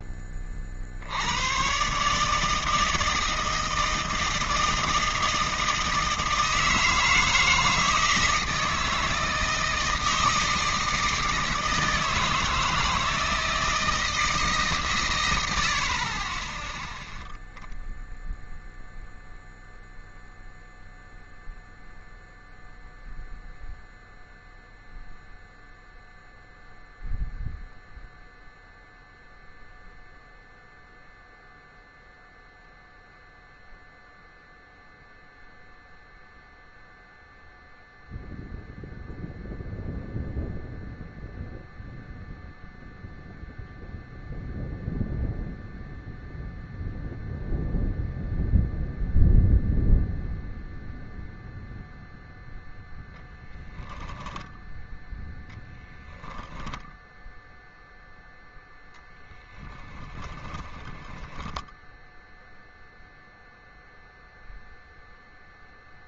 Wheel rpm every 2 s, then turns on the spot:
40, 150, 160, 160, 160, 160, 160, 150, 10, 0, 0, 0, 0, 0, 0, 0, 0, 0, 0, 0, 0, 0, 0, 0, 0, 0, 10, 10, 10, 0, 10, 0, 0.
54-58 60-62